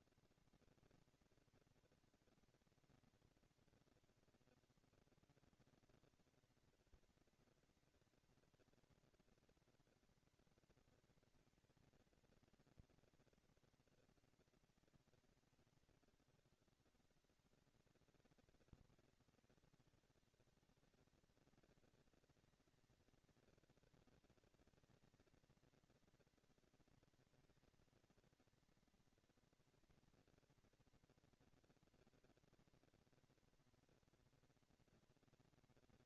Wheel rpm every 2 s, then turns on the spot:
230, 230, 230, 230, 230, 230, 230, 230, 210, 190, 210, 230, 230, 230, 230, 230, 230, 230.
none